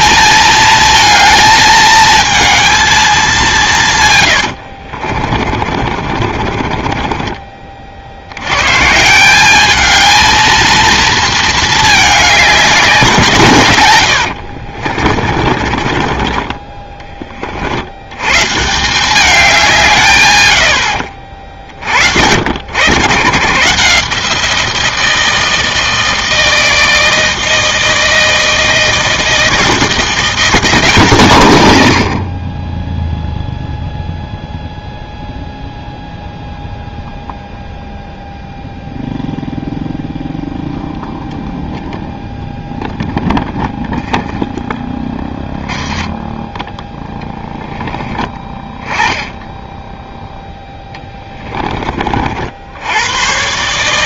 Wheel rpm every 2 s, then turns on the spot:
220, 220, 80, 40, 120, 230, 190, 50, 20, 150, 80, 120, 160, 160, 160, 170, 20, 0, 0, 0, 0, 0, 10, 10, 10, 10, 70.
4-8 14-16 44-48 50-52